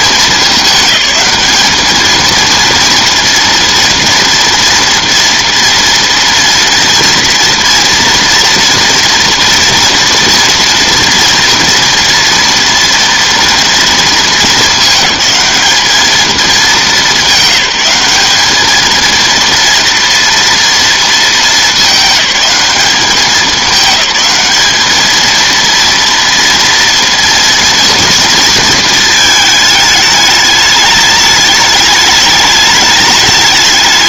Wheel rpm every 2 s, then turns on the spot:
210, 230, 240, 230, 230, 230, 230, 220, 210, 220, 230, 200, 220, 230, 220, 210, 210.
none